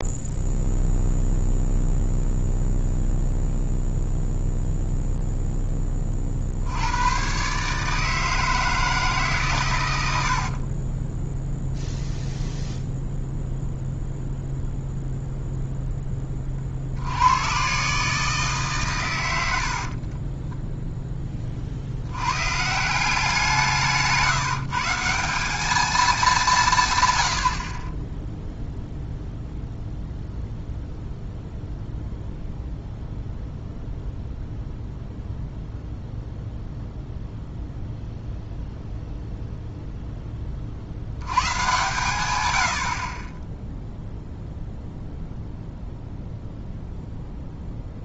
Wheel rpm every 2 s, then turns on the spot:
0, 0, 0, 80, 160, 40, 0, 0, 50, 140, 10, 150, 170, 170, 0, 0, 0, 0, 0, 0, 50, 80, 0, 0.
10-12